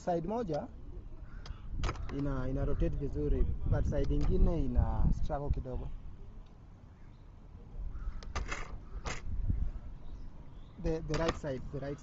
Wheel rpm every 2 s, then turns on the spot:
0, 0, 0, 0, 0, 0.
none